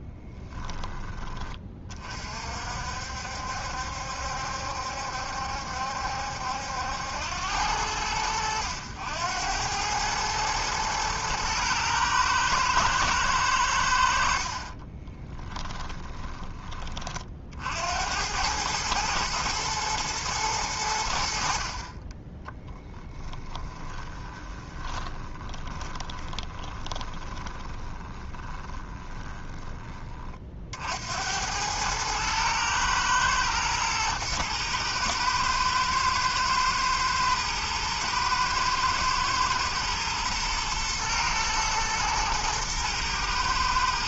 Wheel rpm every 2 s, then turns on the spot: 20, 60, 70, 80, 90, 110, 110, 30, 20, 110, 90, 10, 20, 20, 10, 60, 110, 110, 110, 120, 110, 120.
14-16 24-30